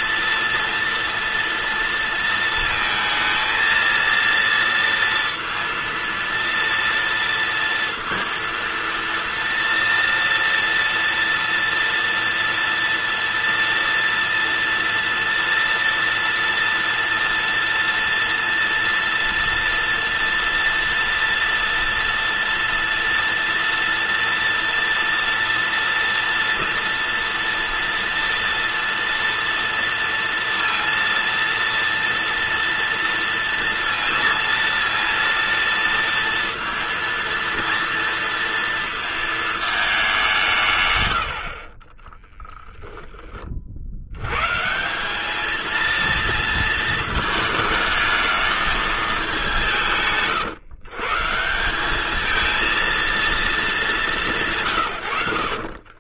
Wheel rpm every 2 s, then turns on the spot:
230, 220, 230, 230, 230, 230, 230, 230, 230, 230, 230, 230, 230, 230, 230, 230, 230, 230, 230, 230, 90, 10, 170, 220, 210, 150, 230, 120.
none